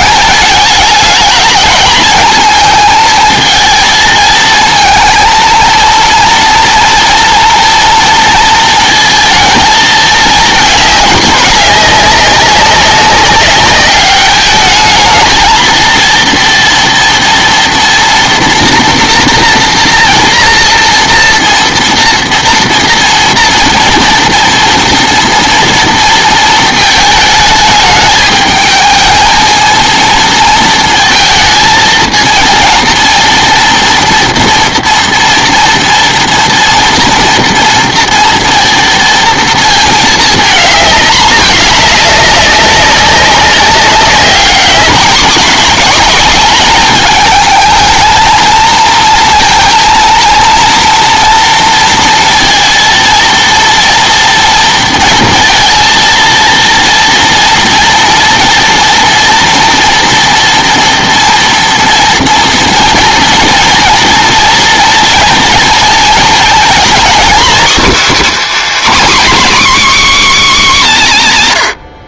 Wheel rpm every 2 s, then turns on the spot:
210, 220, 230, 230, 230, 210, 200, 210, 230, 240, 230, 230, 230, 220, 220, 220, 230, 230, 230, 230, 220, 200, 200, 210, 230, 230, 230, 230, 230, 230, 230, 230, 240, 250, 330, 220.
none